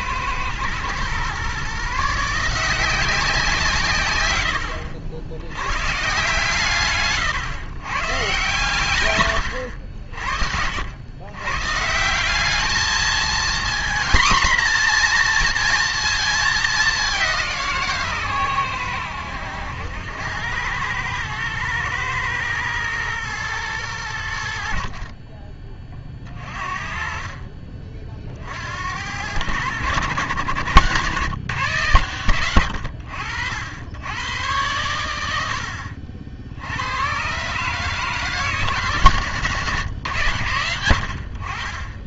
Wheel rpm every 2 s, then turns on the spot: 110, 170, 80, 150, 130, 70, 210, 240, 210, 110, 100, 110, 60, 40, 60, 130, 90, 110, 80, 160, 100.
none